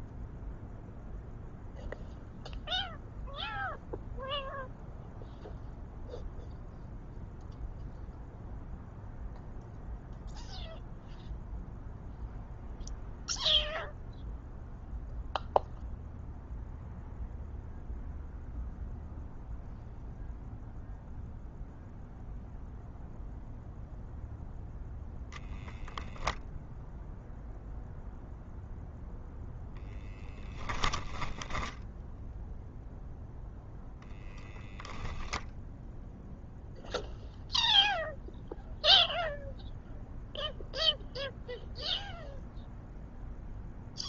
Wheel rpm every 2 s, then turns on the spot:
0, 0, 0, 0, 0, 0, 0, 0, 0, 0, 0, 0, 0, 0, 0, 10, 0, 0, 0, 0, 0, 0.
30-32